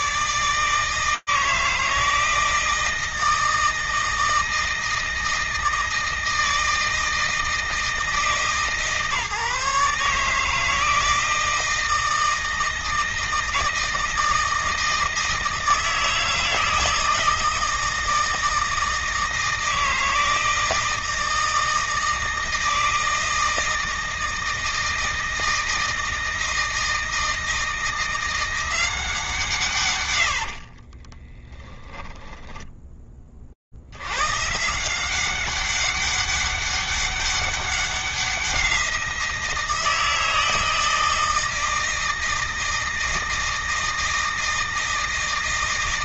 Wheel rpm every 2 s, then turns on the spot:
160, 160, 160, 160, 150, 160, 160, 160, 160, 160, 160, 160, 160, 160, 180, 70, 20, 160, 200, 180, 160, 160, 160.
30-32